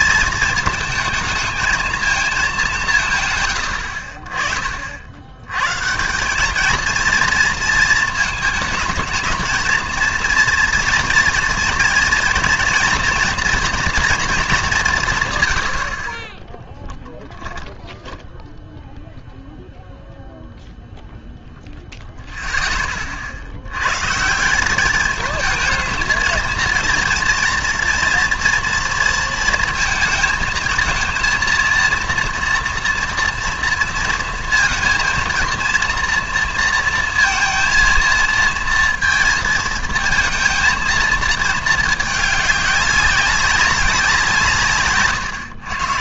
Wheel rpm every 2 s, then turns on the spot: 220, 190, 40, 210, 220, 230, 240, 200, 10, 0, 0, 10, 190, 230, 230, 220, 230, 230, 230, 230, 220, 210, 140.
none